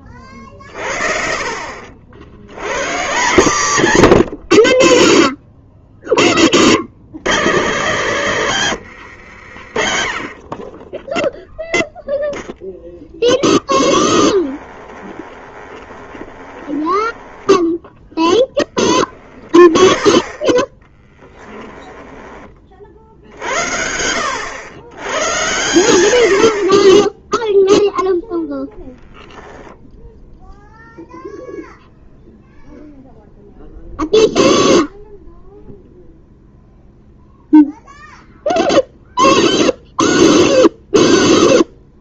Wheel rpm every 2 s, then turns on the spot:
30, 120, 60, 50, 140, 20, 0, 20, 20, 10, 10, 30, 100, 50, 10, 0, 0, 0, 0, 0, 0.
14-18